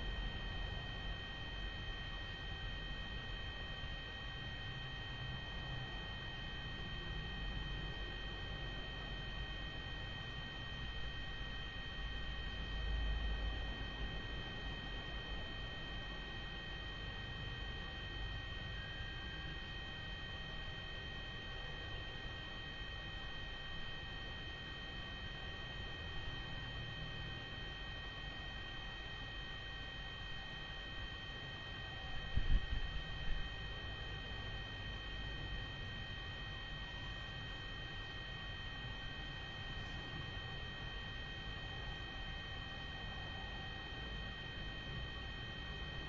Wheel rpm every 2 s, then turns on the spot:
0, 0, 0, 0, 0, 0, 0, 0, 0, 0, 0, 0, 0, 0, 0, 0, 0, 0, 0, 0, 0, 0, 0.
none